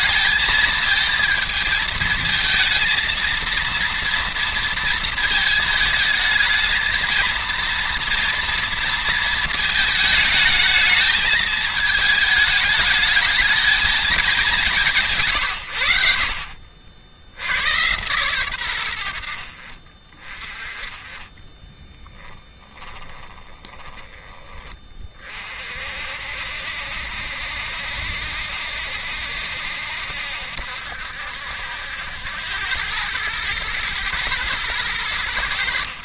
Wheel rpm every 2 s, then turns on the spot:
220, 230, 230, 220, 230, 220, 220, 180, 60, 90, 20, 20, 30, 70, 70, 70, 90, 100.
22-24